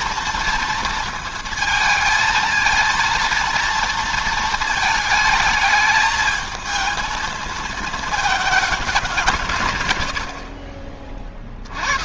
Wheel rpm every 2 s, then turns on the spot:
230, 230, 220, 220, 210, 50.
none